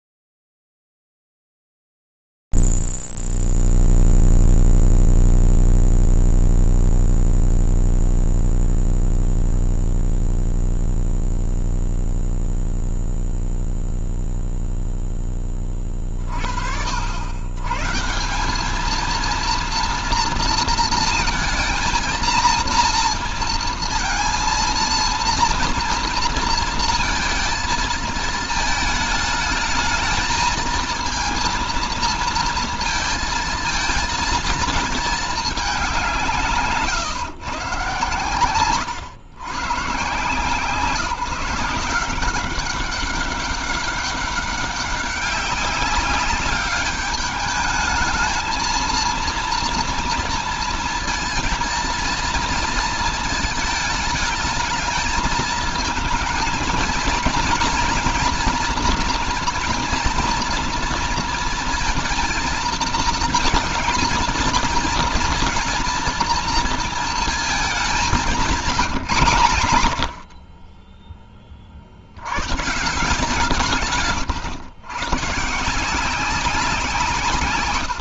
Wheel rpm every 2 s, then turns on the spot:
0, 0, 0, 0, 0, 0, 0, 0, 40, 180, 230, 230, 230, 230, 220, 220, 230, 220, 160, 120, 180, 200, 200, 200, 230, 230, 230, 220, 220, 230, 240, 230, 220, 230, 180, 30, 130, 130, 190.
38-40